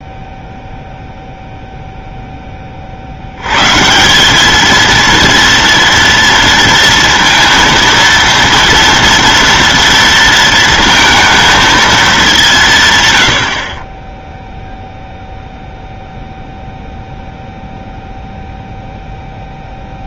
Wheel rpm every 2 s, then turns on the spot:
0, 20, 210, 230, 230, 230, 170, 0, 0, 0.
none